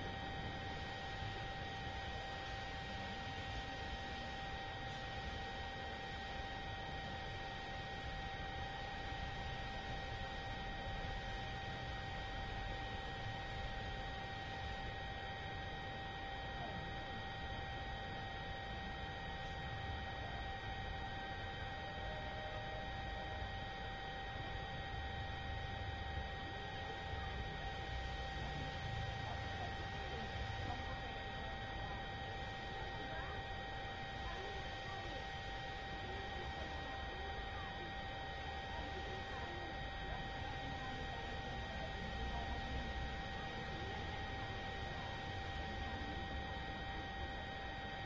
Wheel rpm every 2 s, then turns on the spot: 0, 0, 0, 0, 0, 0, 0, 0, 0, 0, 0, 0, 0, 0, 0, 0, 0, 0, 0, 0, 0, 0, 0, 0.
none